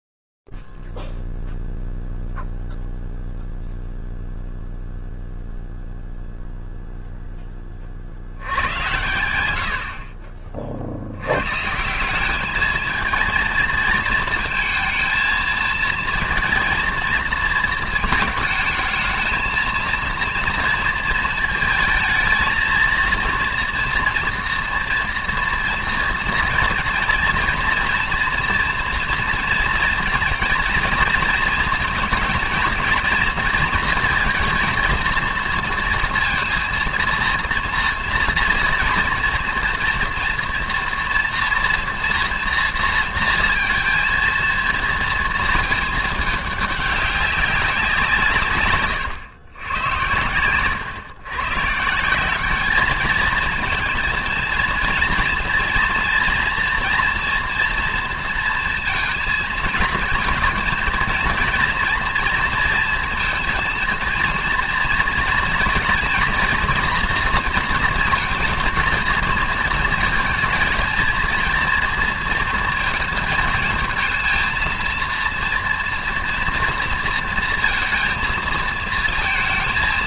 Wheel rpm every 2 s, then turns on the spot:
0, 0, 0, 0, 30, 80, 160, 220, 230, 230, 230, 220, 230, 230, 230, 230, 220, 230, 230, 230, 230, 230, 230, 210, 160, 100, 190, 230, 230, 230, 230, 230, 230, 230, 230, 230, 230, 220, 230, 220.
none